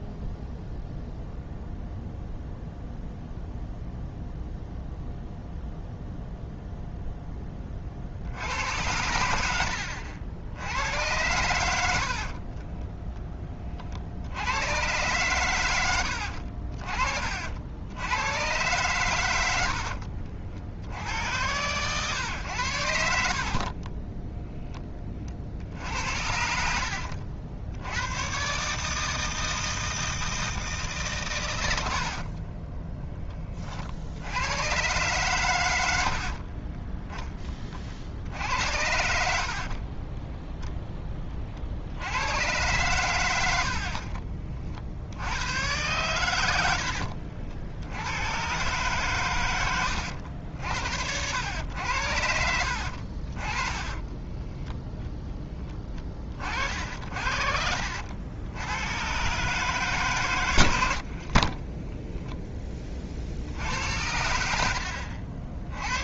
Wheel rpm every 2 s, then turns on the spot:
0, 0, 0, 0, 90, 90, 30, 110, 50, 120, 70, 90, 10, 70, 150, 150, 20, 100, 30, 80, 0, 100, 40, 90, 130, 80, 60, 0, 40, 100, 90, 20, 60.
12-14 46-48 64-66